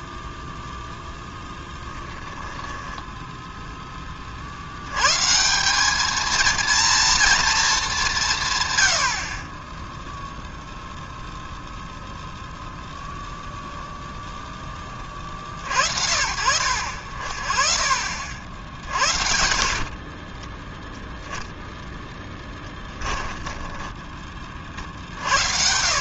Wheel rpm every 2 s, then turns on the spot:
0, 10, 80, 230, 90, 0, 0, 30, 70, 60, 0, 10, 50.
2-4 18-20 22-24